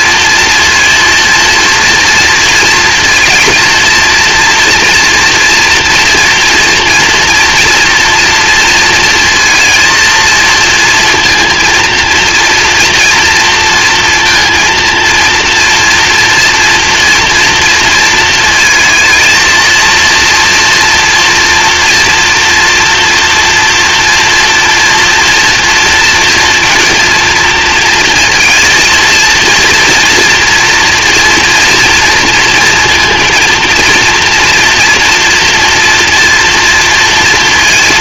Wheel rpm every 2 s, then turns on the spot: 230, 230, 240, 230, 230, 230, 230, 230, 230, 220, 230, 230, 240, 230, 230, 230, 230, 230, 230.
none